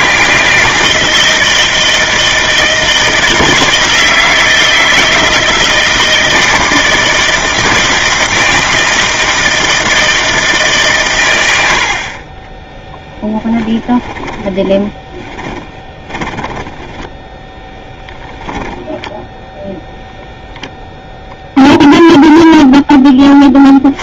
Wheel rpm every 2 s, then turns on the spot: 160, 160, 160, 160, 160, 160, 40, 10, 20, 0, 0, 0.
14-18